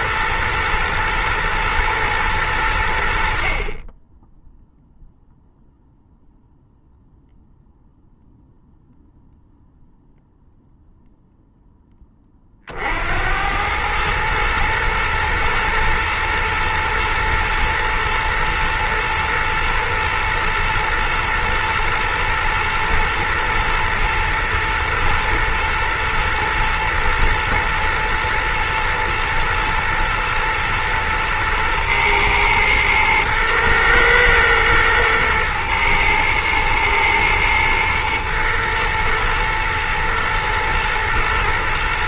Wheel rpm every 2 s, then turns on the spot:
110, 100, 0, 0, 0, 0, 70, 110, 120, 120, 120, 110, 110, 110, 110, 110, 110, 110, 110, 120, 120.
none